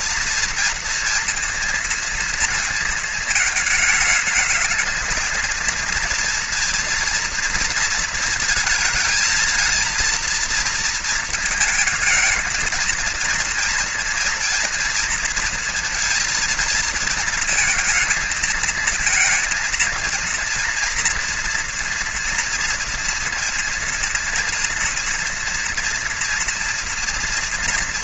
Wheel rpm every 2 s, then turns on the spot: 230, 230, 220, 230, 220, 230, 220, 230, 230, 220, 230, 230, 230, 230.
none